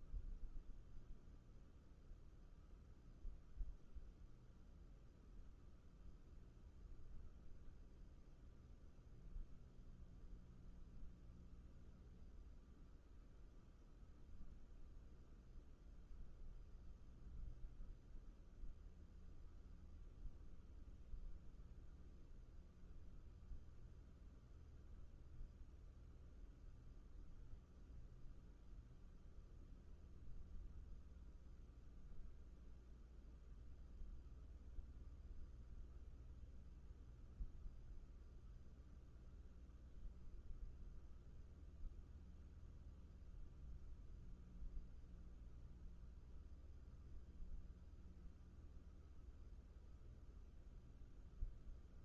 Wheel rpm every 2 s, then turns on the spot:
0, 0, 0, 0, 0, 0, 0, 0, 0, 0, 0, 0, 0, 0, 0, 0, 0, 0, 0, 0, 0, 0, 0, 0, 0, 0.
none